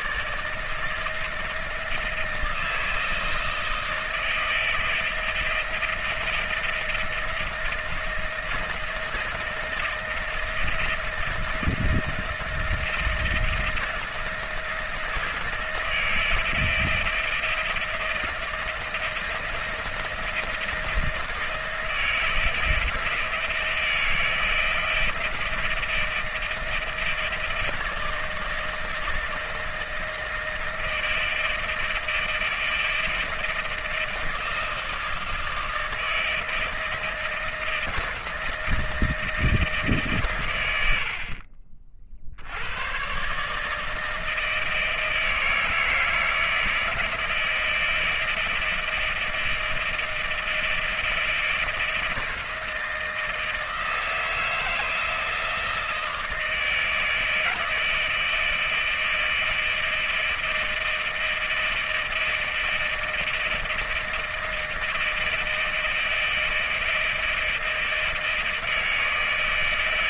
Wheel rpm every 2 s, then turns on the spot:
160, 160, 160, 160, 160, 160, 160, 160, 160, 160, 160, 160, 160, 160, 160, 160, 160, 160, 160, 160, 60, 120, 160, 160, 160, 160, 160, 160, 160, 160, 160, 160, 160, 160, 160.
none